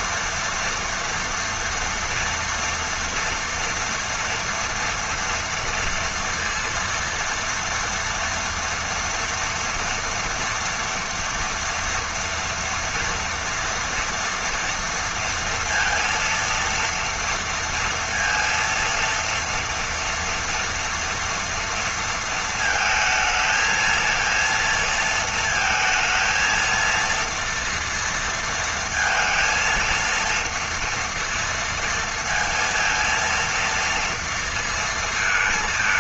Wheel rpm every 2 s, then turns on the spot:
230, 230, 230, 230, 240, 230, 230, 230, 230, 230, 230, 220, 230, 230, 230, 230, 230, 230.
none